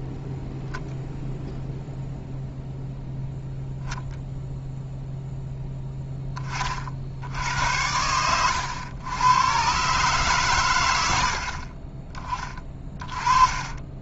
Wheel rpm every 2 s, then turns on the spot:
0, 0, 0, 50, 100, 110, 20.
none